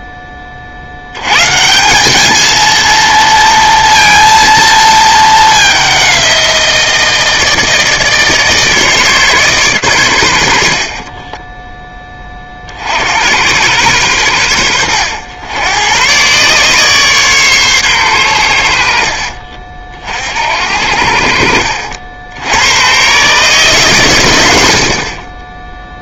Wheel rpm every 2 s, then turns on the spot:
40, 220, 230, 170, 150, 80, 40, 90, 130, 90, 60, 100, 70.
none